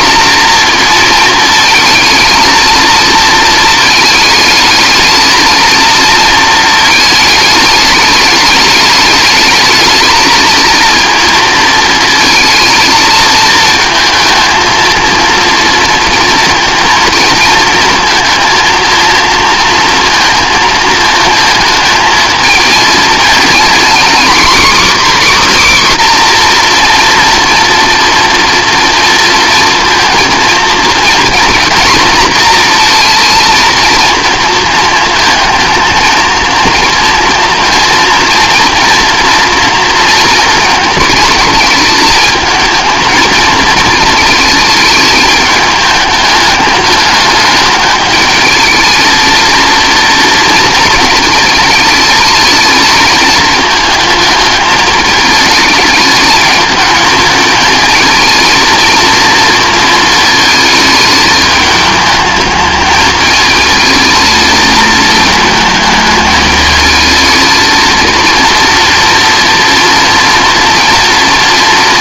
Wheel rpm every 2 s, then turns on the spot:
230, 220, 220, 220, 210, 230, 220, 220, 230, 230, 220, 220, 270, 250, 230, 230, 230, 230, 230, 240, 230, 220, 220, 210, 220, 230, 220, 210, 210, 230, 220, 210, 220, 220, 230, 230.
none